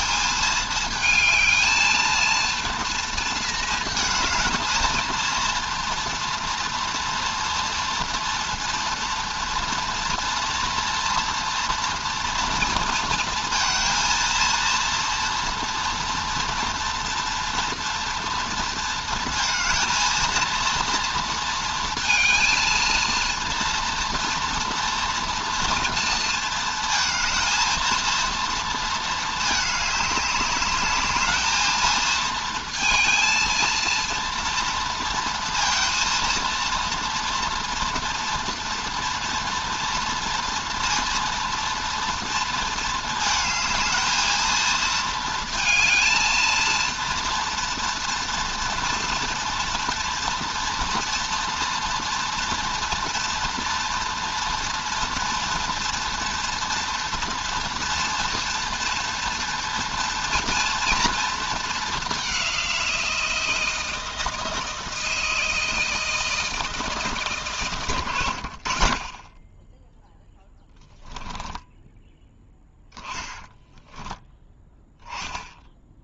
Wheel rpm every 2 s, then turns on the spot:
210, 220, 220, 230, 230, 230, 230, 230, 230, 230, 230, 230, 240, 230, 230, 200, 230, 230, 230, 230, 230, 220, 220, 220, 240, 240, 240, 230, 230, 230, 230, 190, 160, 160, 70, 0, 10, 10.
68-70 72-74